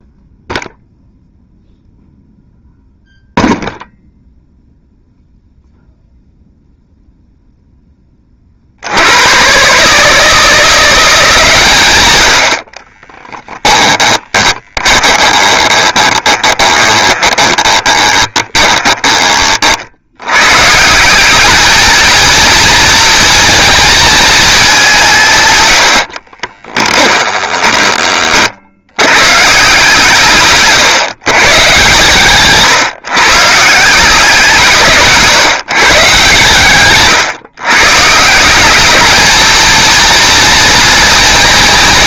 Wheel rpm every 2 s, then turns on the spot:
0, 0, 0, 0, 70, 170, 30, 20, 20, 10, 150, 230, 190, 20, 100, 130, 140, 160, 140, 200, 230.
12-20 26-28